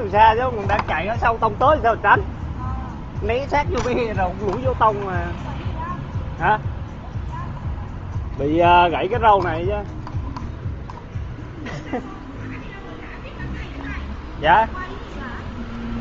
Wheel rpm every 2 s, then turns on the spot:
0, 0, 0, 0, 0, 0, 0, 0.
none